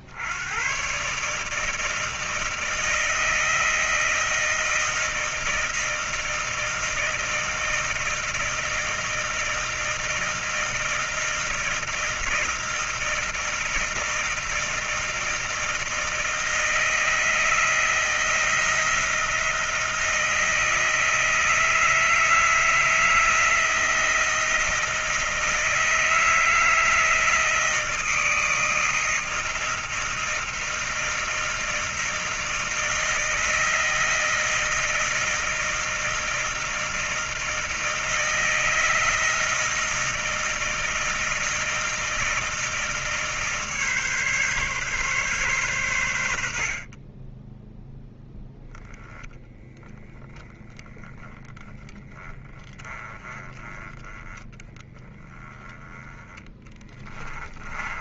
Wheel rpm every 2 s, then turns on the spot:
70, 160, 160, 160, 160, 160, 160, 160, 160, 160, 160, 160, 160, 160, 160, 160, 160, 160, 160, 160, 160, 160, 150, 100, 10, 10, 10, 10, 10.
56-58